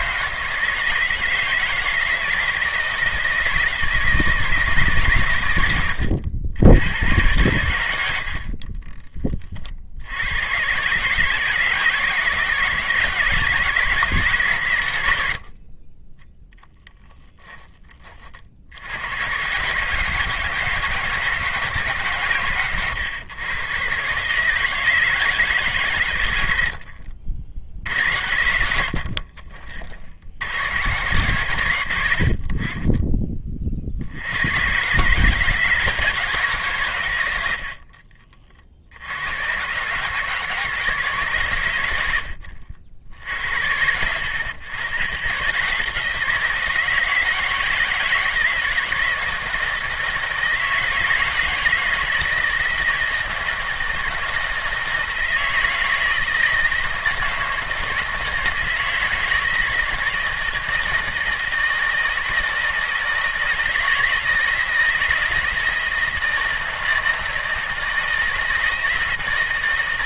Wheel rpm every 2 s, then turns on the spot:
160, 160, 140, 100, 30, 130, 160, 80, 0, 80, 160, 120, 160, 70, 70, 120, 20, 130, 130, 70, 150, 60, 100, 160, 160, 160, 160, 160, 160, 160, 160, 160, 160, 160, 160.
8-10